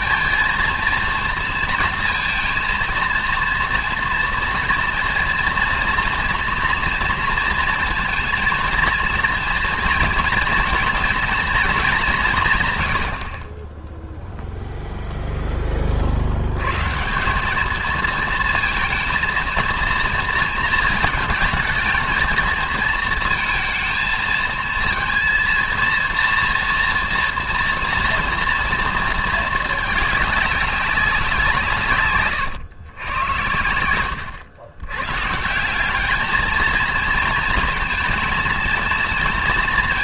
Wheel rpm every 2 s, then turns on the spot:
230, 230, 230, 230, 230, 230, 130, 0, 120, 230, 230, 220, 230, 230, 230, 200, 110, 90, 230, 230.
none